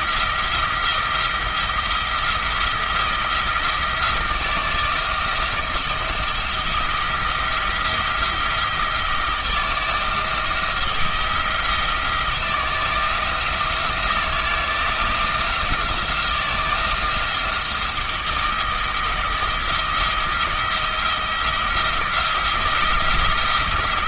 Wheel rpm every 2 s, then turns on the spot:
170, 170, 170, 170, 170, 170, 170, 170, 170, 170, 170, 170.
none